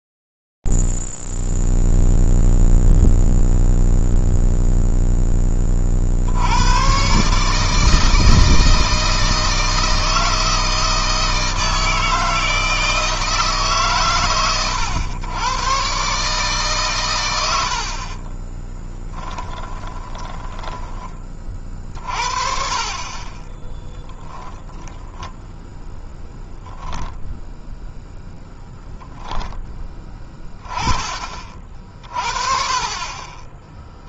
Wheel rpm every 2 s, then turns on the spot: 0, 0, 0, 60, 160, 160, 160, 130, 140, 40, 10, 40, 0, 0, 0, 20, 30.
18-22